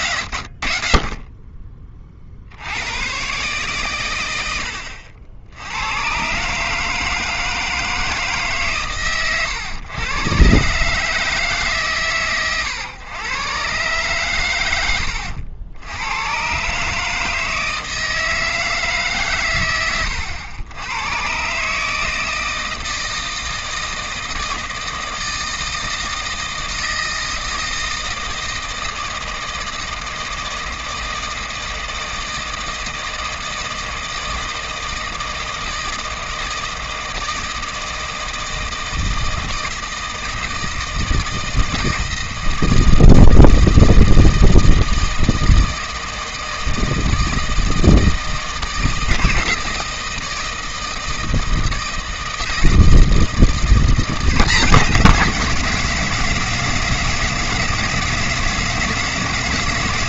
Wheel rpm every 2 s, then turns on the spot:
40, 80, 80, 150, 140, 140, 120, 110, 130, 160, 90, 160, 160, 160, 160, 160, 160, 160, 160, 160, 160, 160, 160, 160, 160, 160, 160, 190, 180, 180.
none